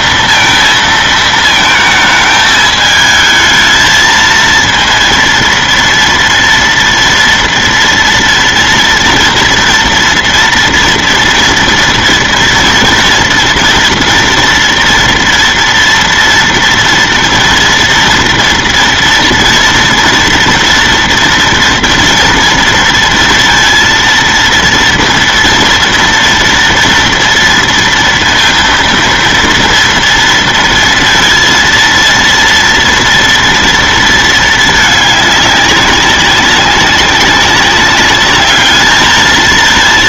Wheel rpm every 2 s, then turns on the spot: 230, 220, 230, 230, 230, 230, 230, 230, 230, 230, 230, 230, 230, 230, 230, 230, 230, 220, 190, 210.
none